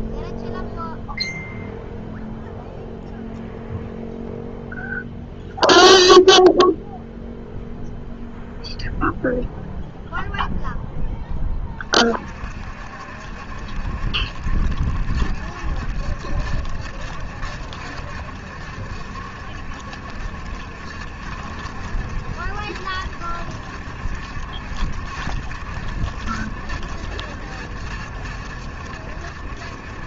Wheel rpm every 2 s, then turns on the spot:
0, 0, 0, 0, 0, 0, 50, 70, 70, 70, 70, 70, 70, 70, 70.
none